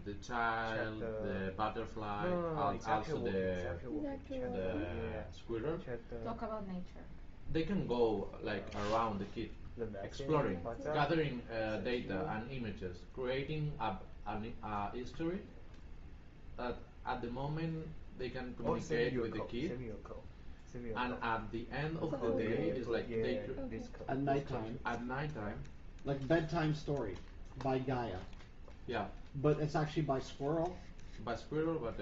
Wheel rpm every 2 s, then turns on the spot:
0, 0, 0, 0, 0, 0, 0, 0, 0, 0, 0, 0, 0, 0, 0, 0.
none